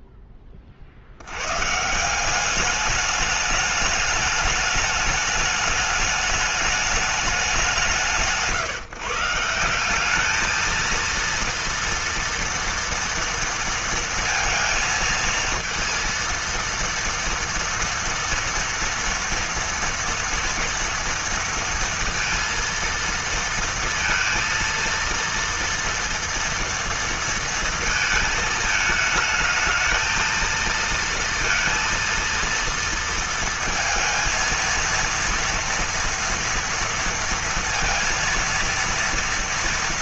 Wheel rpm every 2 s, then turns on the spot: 30, 200, 210, 210, 140, 220, 230, 230, 230, 230, 230, 230, 230, 230, 220, 230, 230, 230, 230, 230.
none